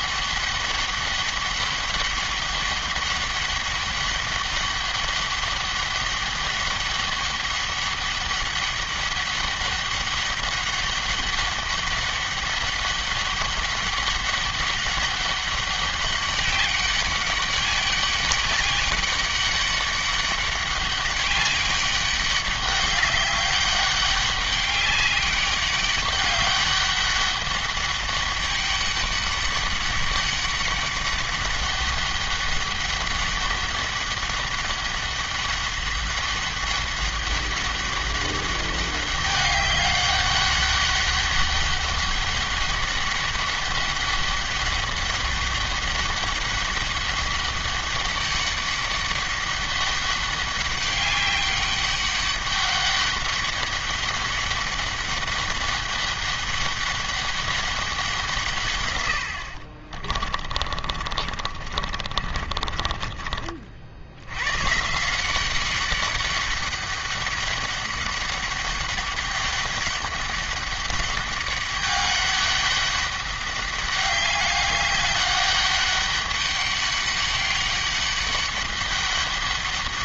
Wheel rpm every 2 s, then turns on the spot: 200, 200, 200, 200, 200, 200, 200, 200, 200, 200, 200, 200, 200, 200, 200, 200, 200, 200, 200, 200, 200, 200, 200, 200, 200, 200, 200, 200, 200, 130, 40, 30, 140, 200, 200, 200, 200, 200, 200, 200.
60-64